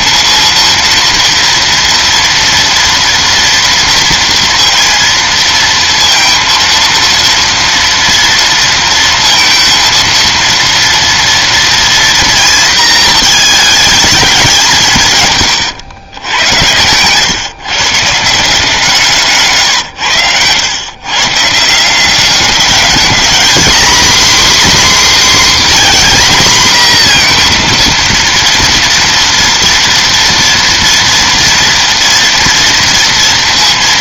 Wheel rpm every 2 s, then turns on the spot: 230, 230, 230, 230, 230, 230, 230, 190, 90, 170, 100, 200, 260, 240, 230, 230, 230.
16-18